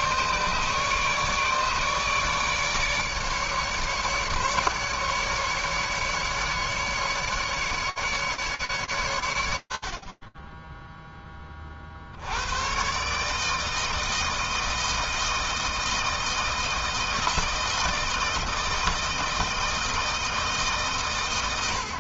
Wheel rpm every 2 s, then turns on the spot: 150, 150, 150, 150, 100, 10, 140, 160, 160, 160, 120.
none